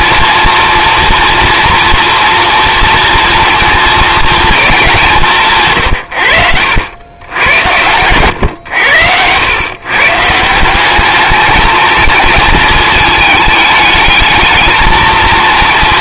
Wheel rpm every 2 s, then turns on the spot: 240, 240, 210, 80, 100, 180, 230, 220.
none